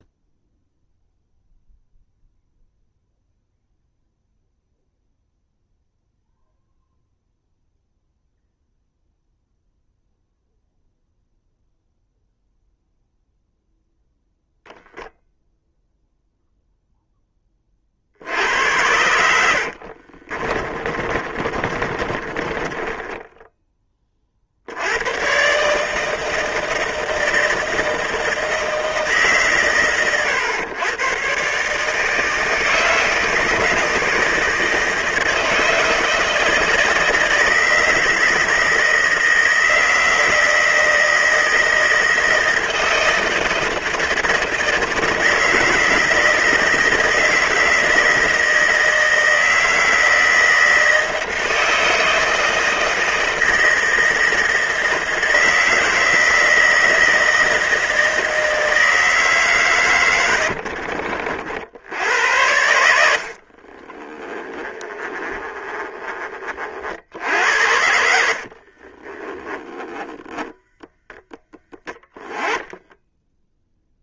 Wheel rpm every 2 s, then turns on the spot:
0, 0, 0, 0, 0, 0, 0, 0, 0, 90, 40, 20, 90, 160, 160, 120, 160, 160, 160, 160, 160, 160, 160, 160, 160, 160, 160, 160, 160, 160, 60, 90, 20, 50, 40, 0, 10.
18-24 60-62 64-66 68-70 72-74